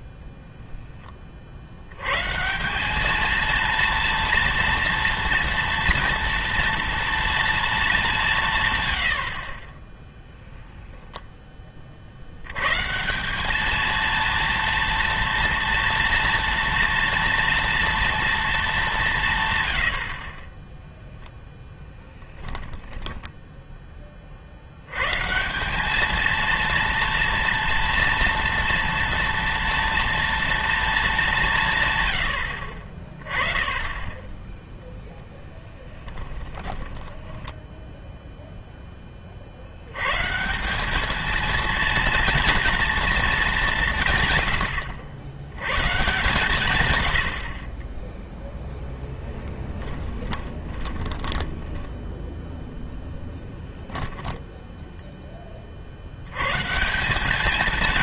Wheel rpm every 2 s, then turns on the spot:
0, 180, 230, 230, 140, 10, 140, 230, 240, 220, 10, 10, 80, 230, 230, 230, 50, 0, 20, 0, 190, 230, 100, 120, 10, 20, 0, 0, 150.
10-12 22-24 36-38 50-52